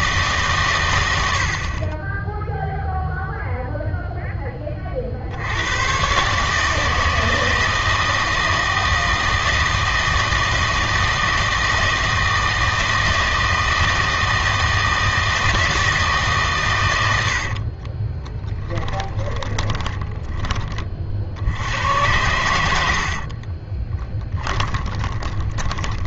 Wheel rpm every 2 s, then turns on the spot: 120, 0, 20, 150, 160, 160, 160, 160, 110, 20, 30, 80, 20.
18-20 24-26